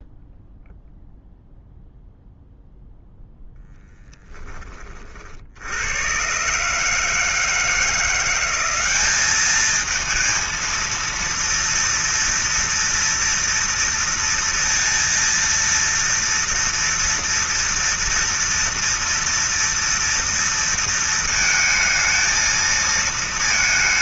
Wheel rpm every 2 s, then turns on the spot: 0, 0, 10, 130, 170, 220, 230, 230, 230, 230, 230, 220.
none